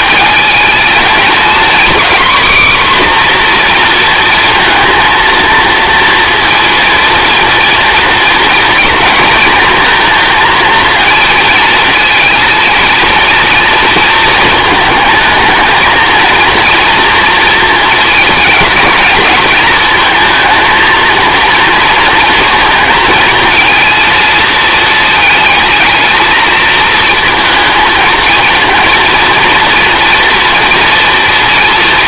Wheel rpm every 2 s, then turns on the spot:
220, 260, 230, 230, 230, 230, 230, 220, 240, 220, 220, 230, 220, 220, 220, 240.
none